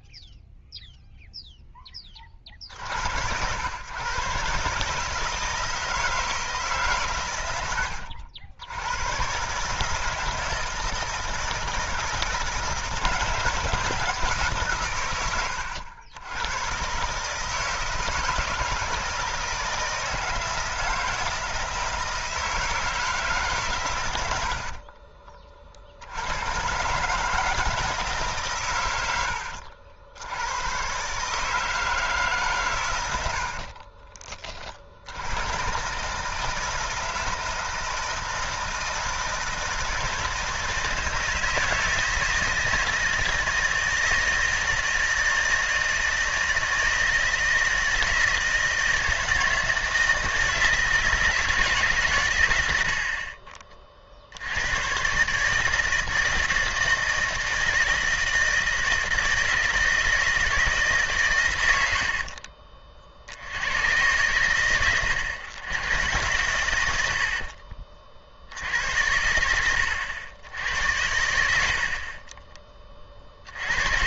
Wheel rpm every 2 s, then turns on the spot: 0, 60, 150, 150, 90, 160, 160, 130, 120, 160, 160, 160, 50, 120, 120, 100, 130, 50, 160, 160, 160, 160, 160, 160, 160, 160, 80, 100, 160, 160, 160, 50, 100, 100, 80, 80, 30.
24-26